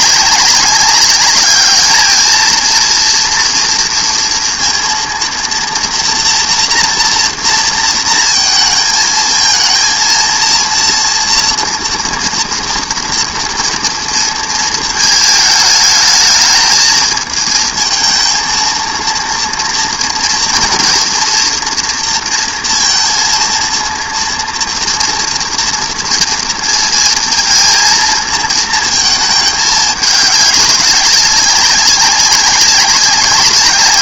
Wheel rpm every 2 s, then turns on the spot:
200, 220, 240, 240, 230, 230, 230, 220, 220, 230, 230, 230, 230, 230, 220, 200, 200.
none